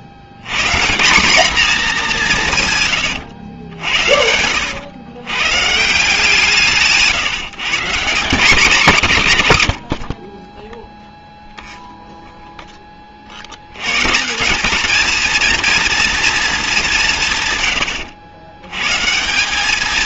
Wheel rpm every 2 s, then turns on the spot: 140, 130, 90, 160, 190, 10, 10, 210, 200, 110.
2-4